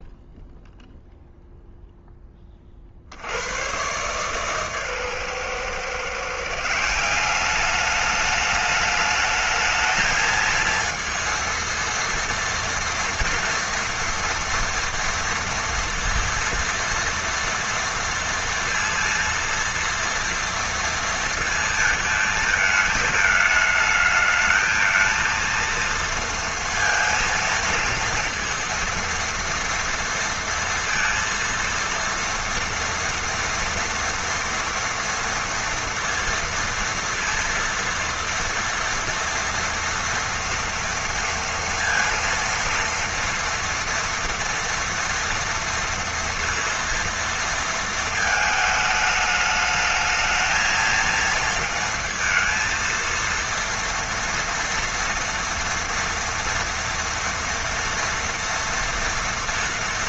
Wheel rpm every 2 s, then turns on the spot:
0, 30, 140, 150, 210, 220, 230, 230, 230, 230, 230, 220, 220, 230, 230, 230, 230, 230, 230, 230, 230, 230, 230, 230, 220, 220, 230, 230, 230, 230.
none